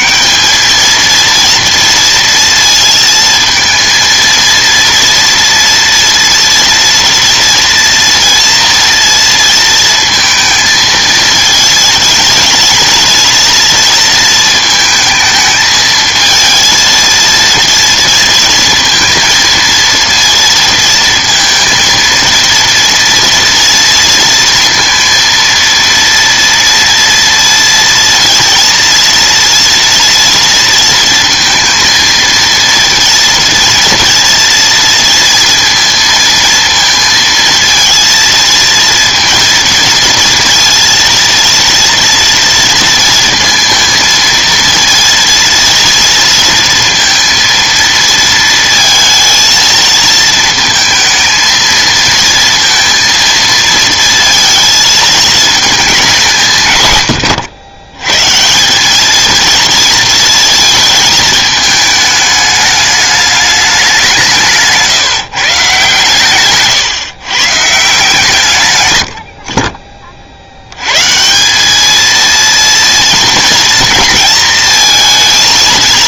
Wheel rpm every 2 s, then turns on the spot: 200, 230, 230, 230, 230, 230, 220, 220, 220, 230, 230, 230, 230, 230, 230, 230, 230, 230, 230, 230, 230, 230, 230, 230, 220, 220, 230, 230, 140, 160, 230, 210, 150, 130, 130, 80, 230, 230.
none